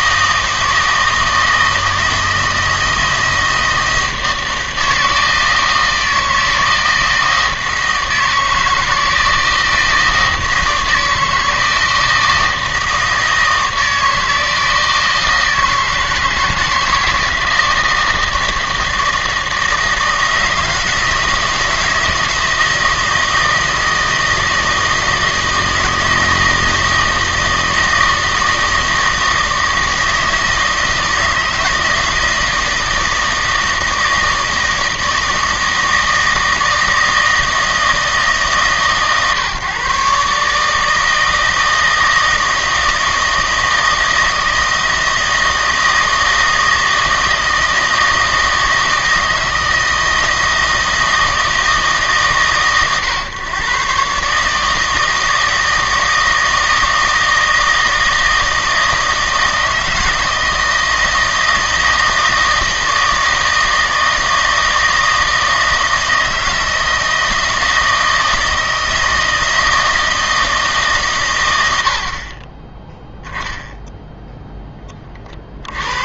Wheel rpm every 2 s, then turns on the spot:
160, 160, 160, 160, 160, 160, 160, 160, 160, 160, 170, 160, 160, 160, 160, 160, 160, 160, 160, 140, 150, 160, 160, 160, 160, 160, 130, 150, 160, 160, 160, 160, 160, 160, 160, 150, 20, 10.
none